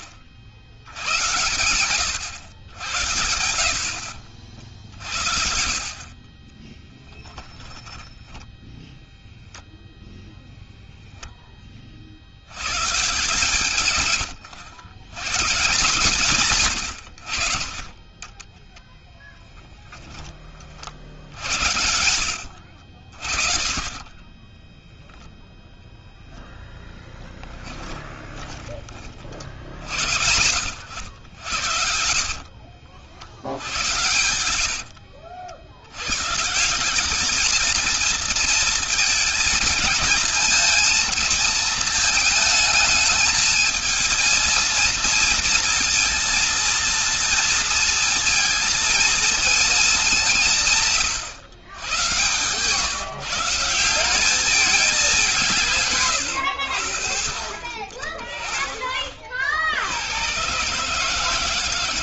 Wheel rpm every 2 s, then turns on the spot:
80, 100, 60, 10, 0, 0, 120, 110, 100, 10, 50, 60, 10, 10, 30, 80, 60, 90, 190, 220, 230, 220, 230, 230, 230, 150, 140, 200, 80, 30, 140.
6-8 18-22 24-28